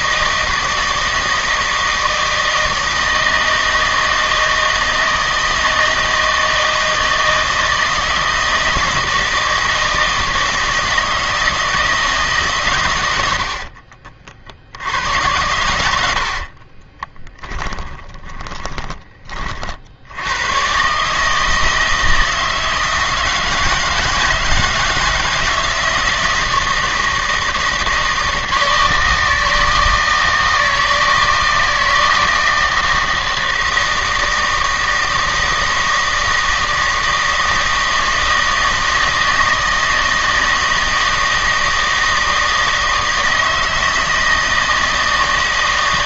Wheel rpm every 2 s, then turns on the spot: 160, 160, 160, 160, 160, 160, 130, 70, 30, 20, 130, 160, 160, 160, 160, 160, 160, 160, 160, 160, 160, 160, 160.
16-20